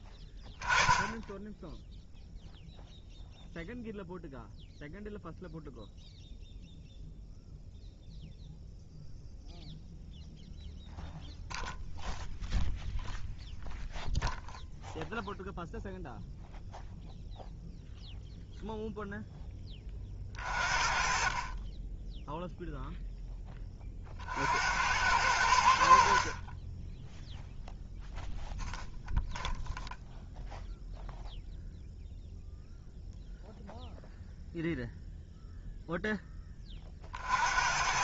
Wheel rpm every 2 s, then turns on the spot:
10, 0, 0, 0, 0, 0, 0, 0, 0, 0, 40, 0, 80, 20, 0, 0, 0, 0, 30.
none